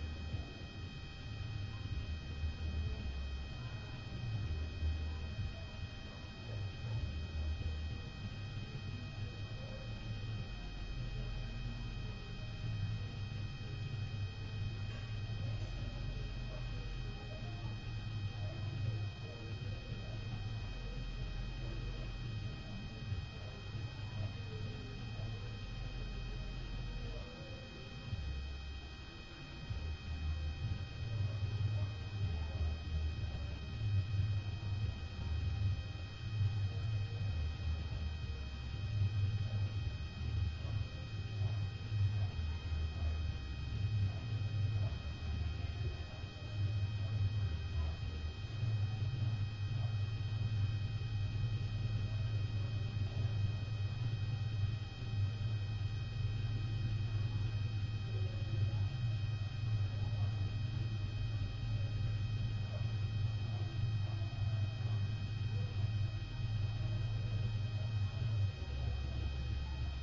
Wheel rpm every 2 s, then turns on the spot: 0, 0, 0, 0, 0, 0, 0, 0, 0, 0, 0, 0, 0, 0, 0, 0, 0, 0, 0, 0, 0, 0, 0, 0, 0, 0, 0, 0, 0, 0, 0, 0, 0, 0, 0.
none